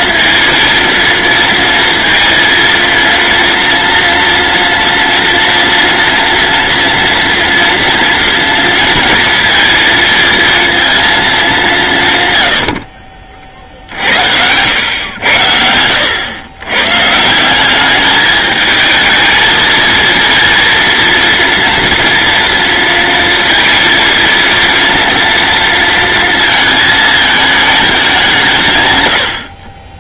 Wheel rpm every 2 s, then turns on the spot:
230, 230, 240, 240, 230, 230, 50, 100, 120, 220, 230, 230, 230, 220, 130.
none